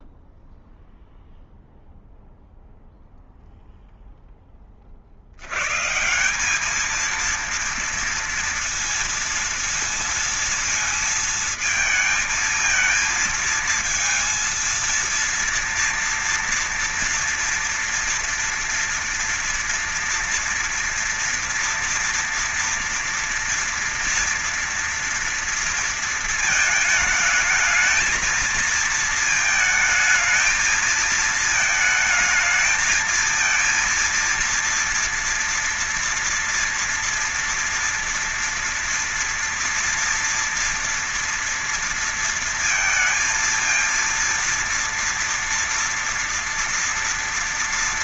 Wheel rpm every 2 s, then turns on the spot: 0, 0, 20, 190, 230, 230, 220, 230, 230, 240, 230, 230, 230, 220, 230, 220, 220, 230, 230, 230, 230, 230, 230, 230.
none